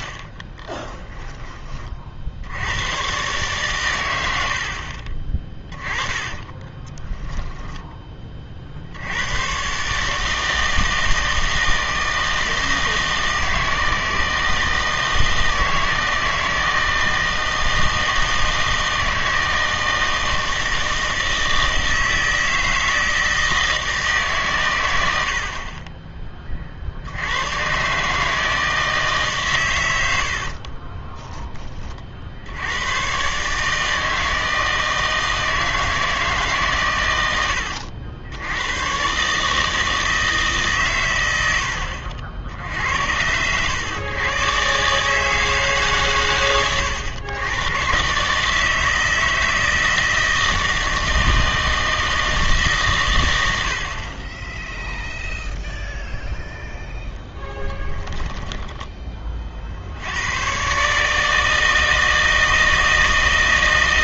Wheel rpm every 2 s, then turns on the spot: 20, 90, 60, 20, 60, 160, 160, 160, 160, 160, 160, 160, 110, 50, 160, 30, 100, 160, 130, 110, 140, 60, 130, 110, 160, 160, 140, 0, 0, 20, 140, 160.
0-2 6-8 30-32